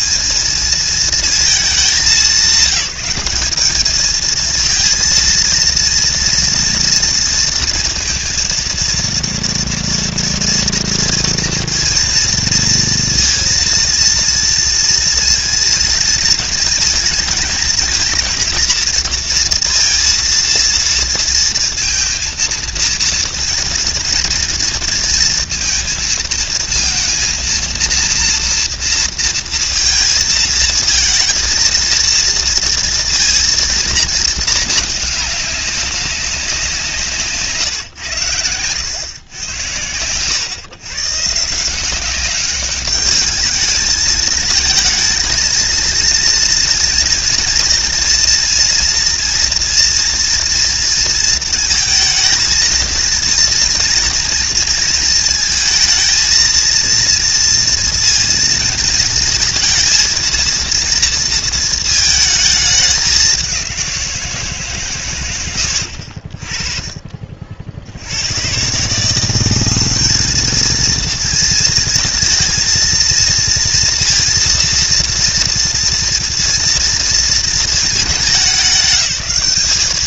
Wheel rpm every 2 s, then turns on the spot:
220, 190, 230, 230, 230, 230, 230, 230, 220, 220, 230, 230, 230, 230, 240, 220, 230, 220, 180, 90, 110, 200, 220, 230, 240, 230, 230, 230, 230, 230, 230, 220, 160, 40, 110, 220, 230, 230, 230, 210.
none